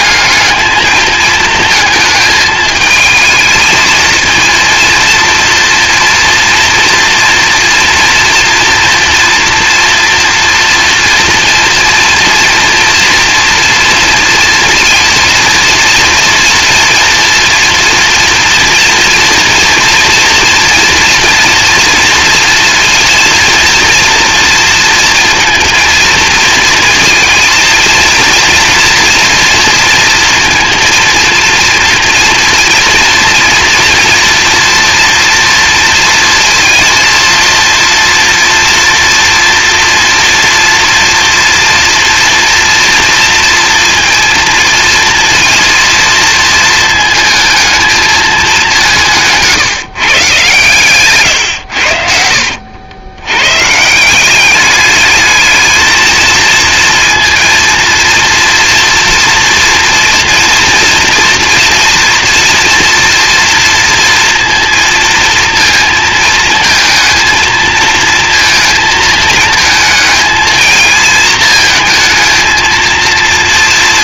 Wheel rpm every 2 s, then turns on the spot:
220, 220, 230, 240, 230, 230, 230, 230, 230, 230, 240, 240, 230, 230, 230, 230, 230, 230, 230, 230, 230, 230, 230, 230, 200, 140, 70, 200, 230, 230, 230, 230, 230, 230, 230, 220, 220.
none